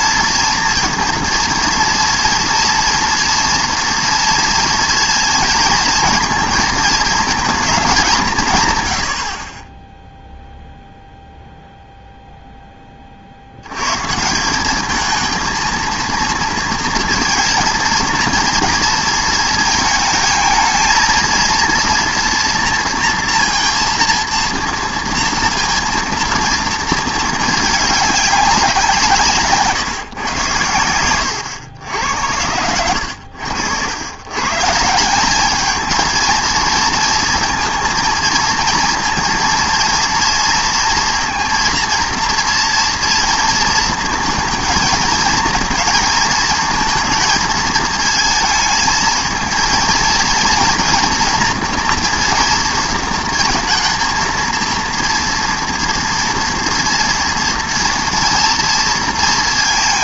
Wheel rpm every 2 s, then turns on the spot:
230, 230, 230, 220, 150, 0, 10, 180, 230, 230, 220, 230, 230, 230, 190, 110, 80, 140, 230, 230, 230, 230, 220, 220, 220, 230, 230, 230, 230, 230.
none